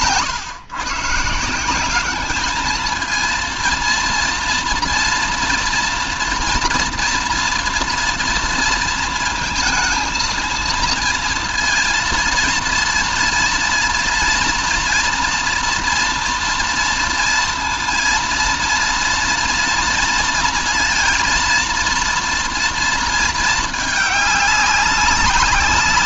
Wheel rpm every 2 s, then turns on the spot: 150, 220, 230, 230, 230, 230, 230, 230, 230, 230, 230, 230, 200.
none